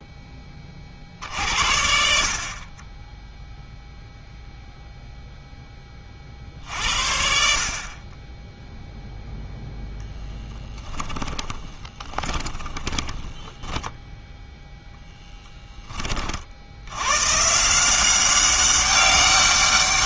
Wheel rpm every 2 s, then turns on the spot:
50, 20, 0, 60, 0, 10, 20, 0, 80, 190.
10-14